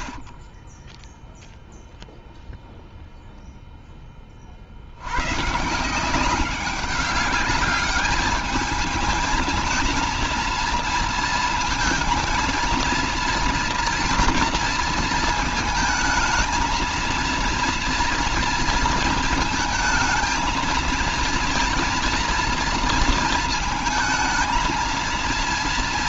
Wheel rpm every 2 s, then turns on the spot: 50, 0, 30, 190, 210, 230, 230, 230, 220, 230, 220, 230, 220.
none